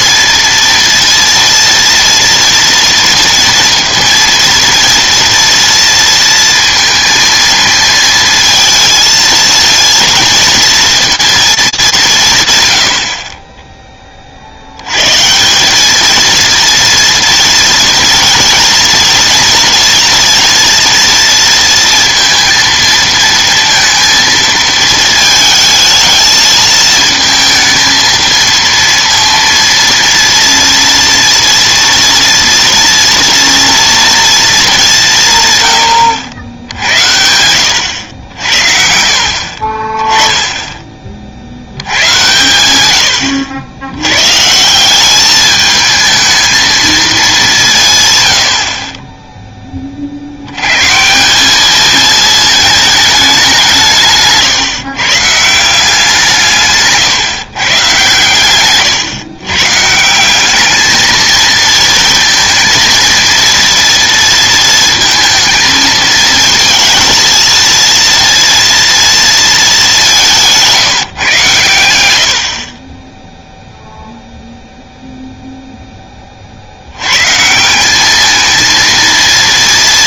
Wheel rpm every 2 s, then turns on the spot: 230, 230, 230, 230, 220, 230, 120, 70, 230, 230, 240, 230, 220, 220, 230, 230, 230, 210, 80, 60, 10, 110, 160, 220, 80, 100, 220, 140, 150, 130, 210, 230, 230, 220, 230, 180, 60, 0, 60, 220.
58-60